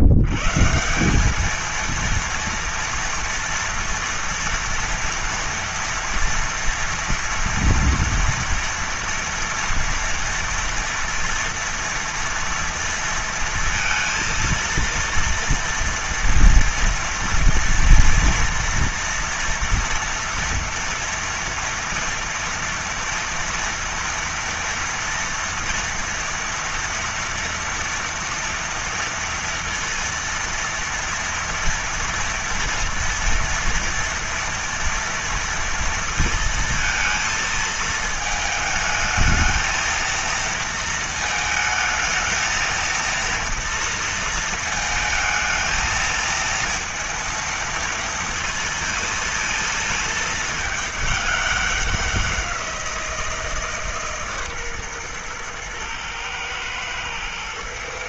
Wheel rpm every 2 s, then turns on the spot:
120, 230, 240, 230, 230, 230, 230, 230, 230, 230, 230, 240, 230, 230, 240, 230, 230, 230, 230, 220, 230, 230, 230, 230, 230, 220, 180, 140, 110.
none